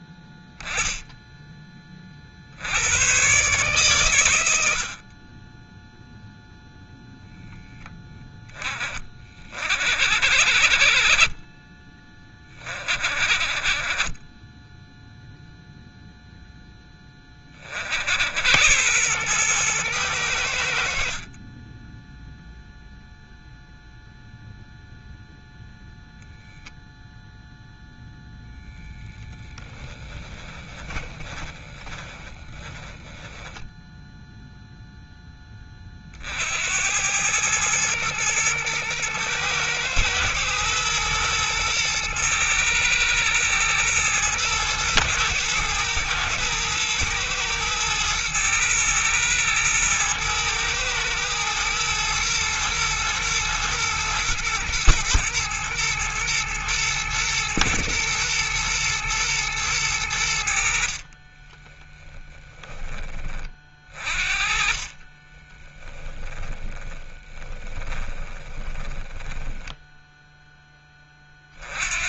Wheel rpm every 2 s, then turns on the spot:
10, 80, 90, 0, 10, 40, 20, 0, 0, 80, 80, 0, 0, 0, 0, 20, 20, 0, 80, 110, 120, 110, 120, 110, 110, 110, 110, 120, 110, 110, 60, 10, 40, 20, 20, 10.
30-34 64-70